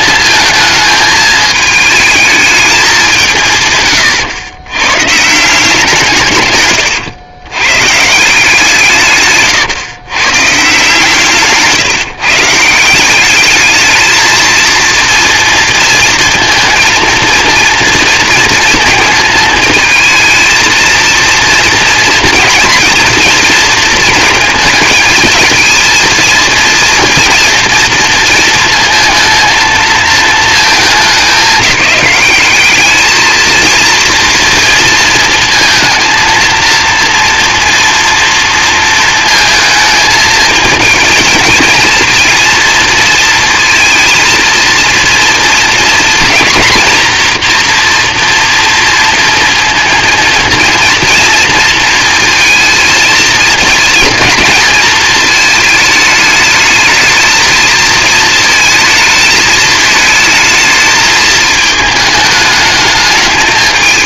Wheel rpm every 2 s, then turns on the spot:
220, 220, 120, 130, 160, 140, 160, 220, 230, 230, 230, 240, 220, 230, 220, 220, 210, 230, 230, 230, 220, 230, 230, 230, 230, 230, 220, 220, 210, 230, 220, 210.
6-8